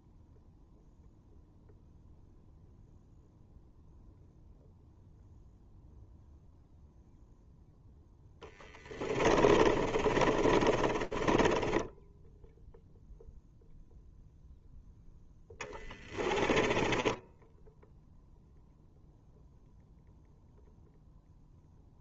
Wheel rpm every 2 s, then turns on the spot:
0, 0, 0, 0, 20, 20, 0, 0, 20, 0, 0.
8-12 16-18